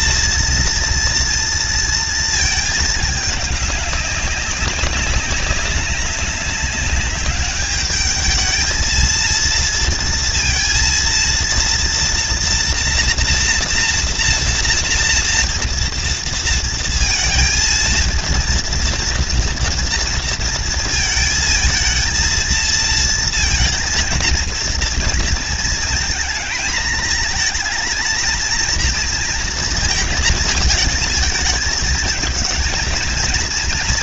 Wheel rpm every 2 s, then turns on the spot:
230, 230, 200, 200, 210, 230, 230, 230, 230, 230, 230, 220, 230, 220, 230, 230, 220.
none